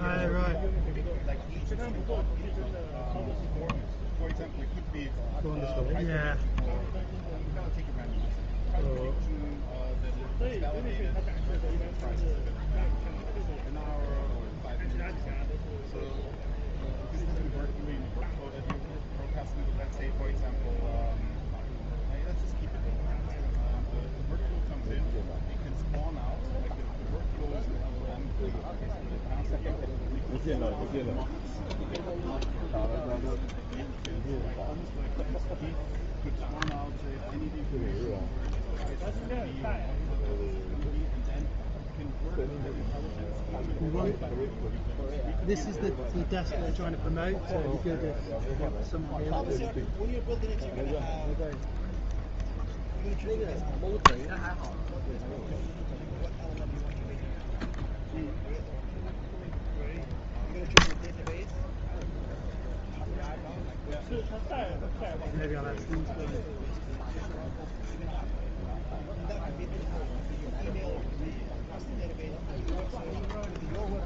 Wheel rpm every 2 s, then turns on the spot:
0, 0, 0, 0, 0, 0, 0, 0, 0, 0, 0, 0, 0, 0, 0, 0, 0, 0, 0, 0, 0, 0, 0, 0, 0, 0, 0, 0, 0, 0, 0, 0, 0, 0, 0, 0, 0.
none